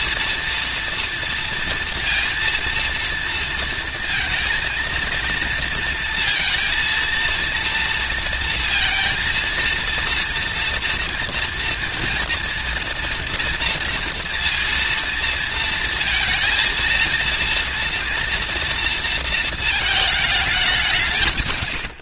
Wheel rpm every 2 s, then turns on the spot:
230, 230, 230, 230, 230, 230, 230, 230, 230, 240, 210.
none